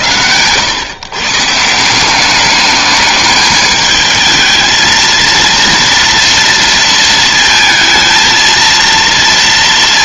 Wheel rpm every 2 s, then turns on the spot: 110, 210, 220, 230, 230.
none